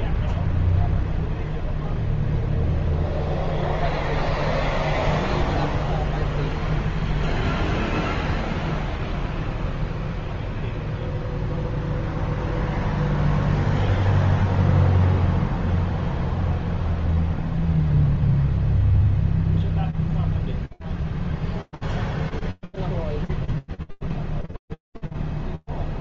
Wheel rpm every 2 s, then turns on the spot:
0, 0, 0, 0, 0, 0, 0, 0, 0, 0, 0, 0, 0.
none